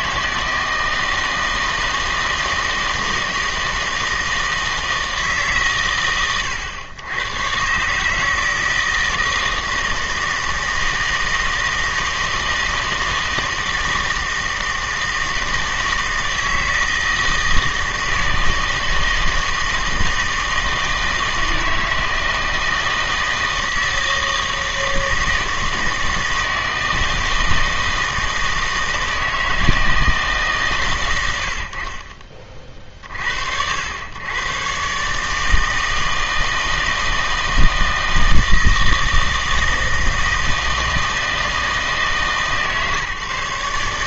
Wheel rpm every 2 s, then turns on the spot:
160, 160, 160, 100, 160, 160, 160, 160, 160, 160, 160, 160, 160, 160, 160, 140, 40, 130, 160, 160, 160, 140.
none